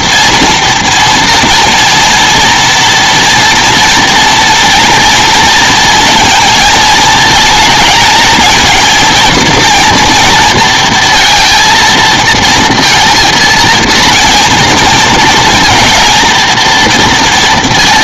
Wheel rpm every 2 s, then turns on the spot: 240, 230, 230, 230, 220, 230, 230, 230, 230.
none